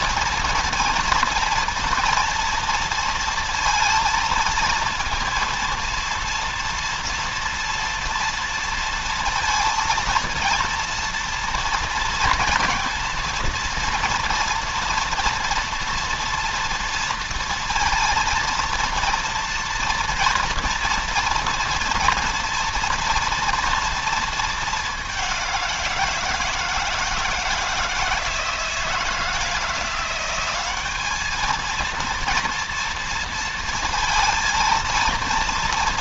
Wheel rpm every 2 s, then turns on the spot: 230, 230, 230, 230, 230, 230, 230, 230, 230, 230, 240, 230, 200, 160, 160, 200, 230, 230.
none